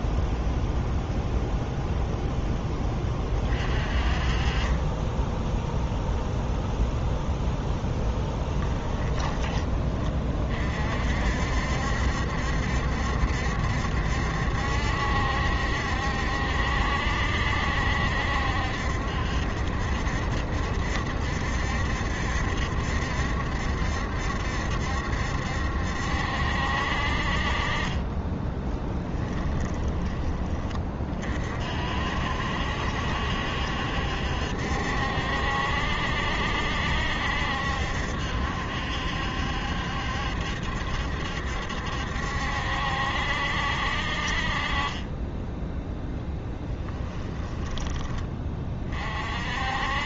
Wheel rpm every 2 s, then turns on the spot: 0, 20, 20, 0, 20, 50, 70, 70, 60, 70, 70, 70, 70, 60, 10, 40, 70, 70, 70, 70, 70, 70, 30, 10, 40.
8-10 28-30 46-48